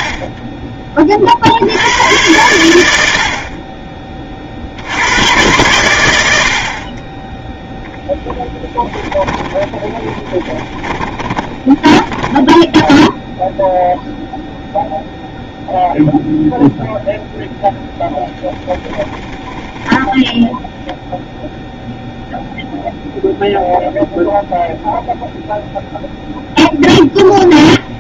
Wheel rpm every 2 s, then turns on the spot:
40, 100, 50, 70, 10, 20, 10, 0, 0, 10, 0, 0, 0, 0.
8-14 18-20